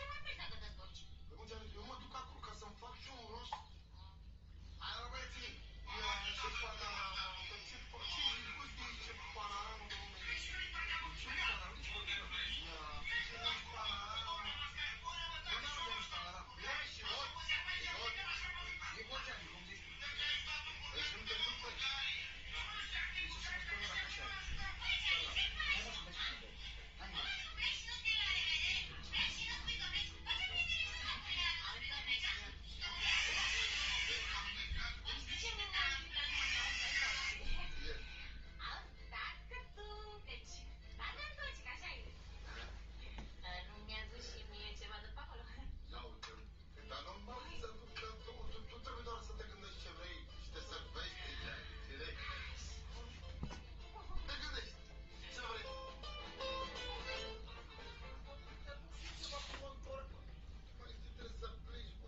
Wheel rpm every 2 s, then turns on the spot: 0, 0, 0, 0, 0, 0, 0, 0, 0, 0, 0, 0, 0, 0, 0, 0, 0, 0, 0, 0, 0, 0, 0, 0, 0, 0, 0, 0, 0, 0, 0.
none